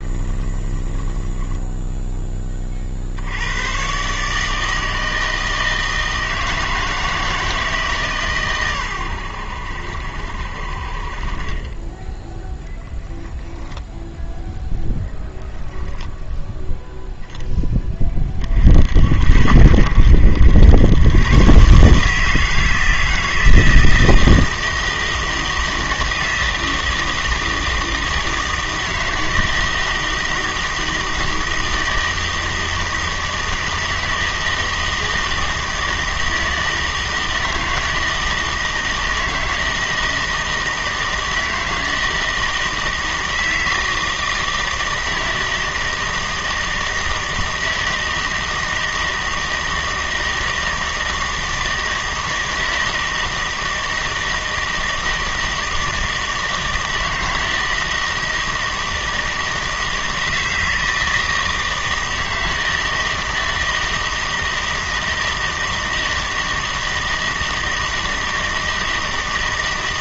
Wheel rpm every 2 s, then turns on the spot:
20, 40, 160, 160, 120, 60, 10, 0, 10, 50, 100, 160, 160, 160, 160, 160, 160, 160, 160, 160, 160, 160, 160, 160, 160, 160, 160, 160, 160, 160, 160, 160, 160, 160, 160.
0-2 12-14